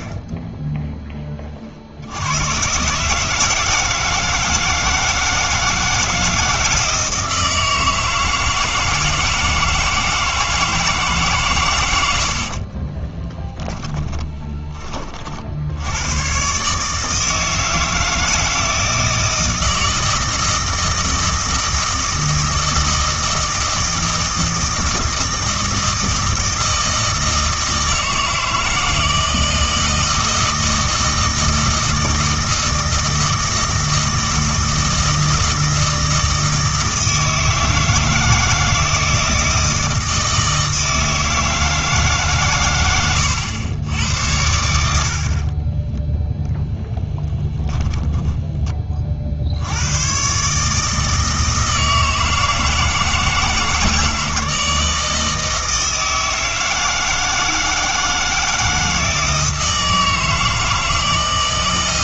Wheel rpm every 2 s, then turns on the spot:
10, 130, 160, 160, 160, 160, 40, 30, 140, 160, 160, 160, 160, 160, 160, 160, 160, 160, 160, 160, 160, 110, 70, 0, 20, 150, 160, 160, 160, 170, 160.
12-16